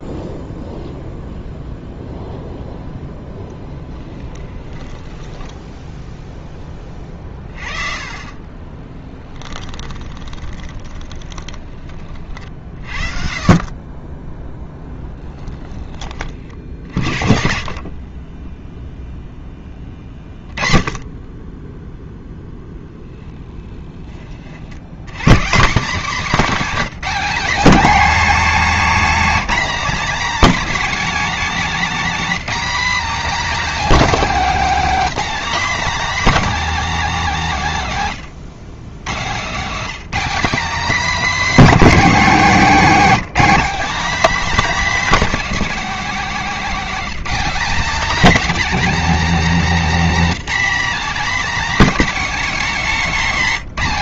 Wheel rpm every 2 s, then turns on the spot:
0, 0, 10, 20, 20, 20, 40, 10, 50, 0, 30, 10, 80, 230, 250, 270, 260, 250, 260, 120, 260, 230, 270, 240, 270, 250, 240.
4-6 8-12 14-18